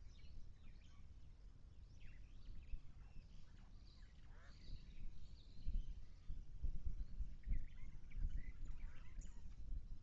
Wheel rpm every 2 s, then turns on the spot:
0, 0, 0, 0, 0.
none